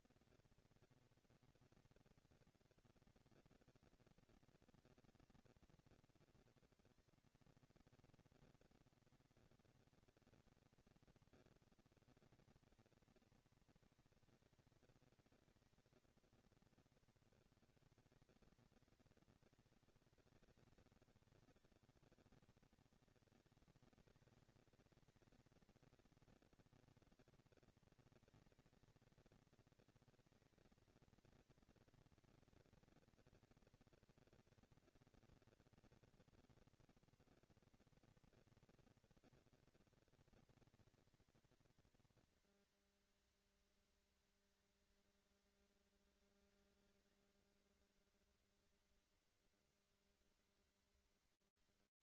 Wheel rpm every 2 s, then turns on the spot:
230, 230, 230, 230, 230, 230, 220, 220, 210, 190, 200, 220, 230, 230, 220, 230, 230, 230, 230, 230, 230, 230, 230, 230, 230, 210.
none